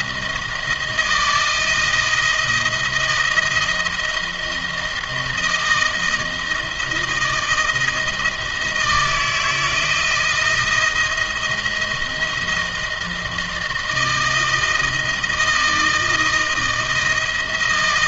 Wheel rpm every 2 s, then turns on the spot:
160, 160, 160, 160, 160, 170, 160, 170, 160.
none